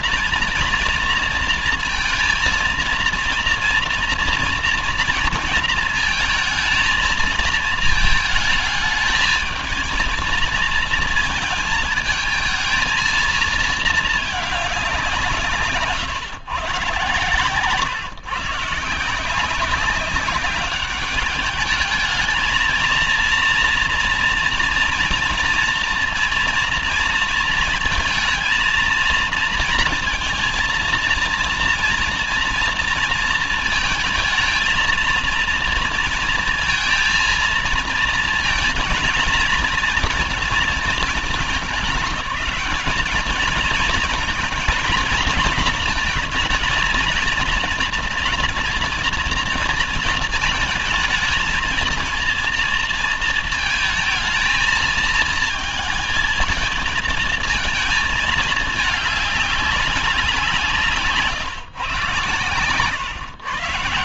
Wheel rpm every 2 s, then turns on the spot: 230, 230, 230, 220, 220, 230, 220, 200, 120, 150, 200, 220, 230, 230, 230, 230, 230, 220, 230, 230, 220, 210, 230, 230, 230, 220, 230, 220, 220, 220, 170, 120.
none